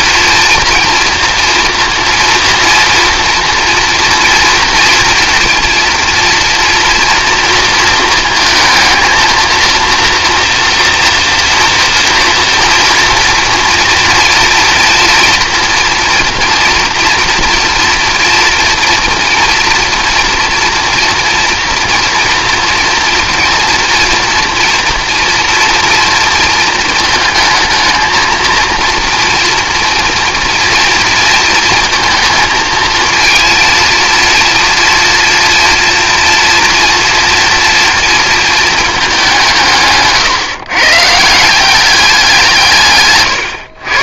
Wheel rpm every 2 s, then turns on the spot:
230, 240, 230, 230, 230, 240, 230, 230, 230, 240, 240, 230, 230, 230, 230, 230, 230, 240, 240, 220, 140, 150.
none